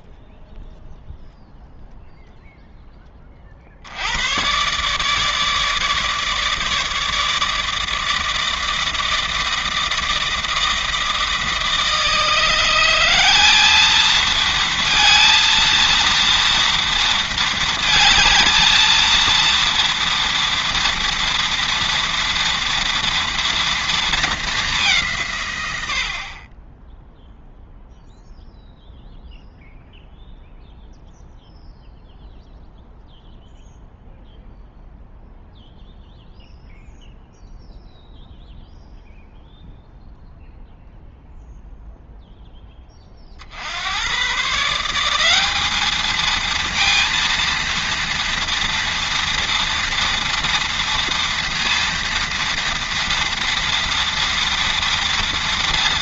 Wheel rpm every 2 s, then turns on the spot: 0, 0, 130, 150, 160, 160, 170, 230, 240, 220, 230, 230, 200, 20, 0, 0, 0, 0, 0, 0, 0, 10, 150, 230, 230, 230, 230, 230.
none